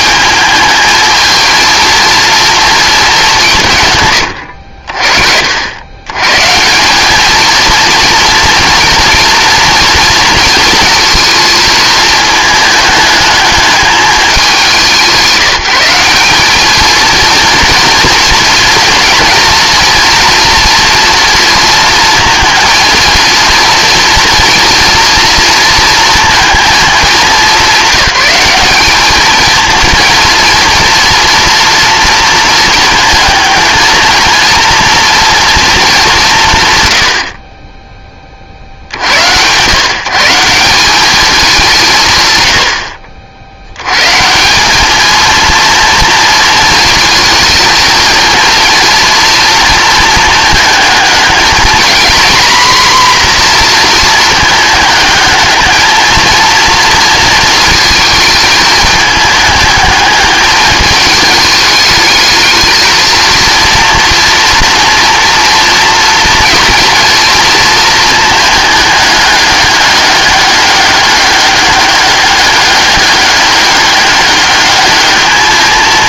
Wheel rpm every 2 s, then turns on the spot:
220, 230, 60, 180, 230, 230, 210, 190, 220, 230, 230, 230, 230, 220, 210, 230, 220, 230, 120, 70, 190, 60, 210, 230, 230, 220, 250, 210, 230, 210, 210, 220, 230, 230, 210, 200, 200, 210.
none